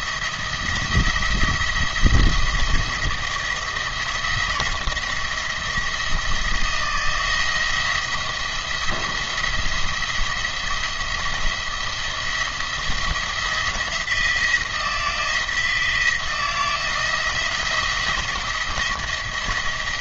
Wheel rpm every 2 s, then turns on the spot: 170, 170, 160, 160, 170, 170, 170, 170, 170, 170.
none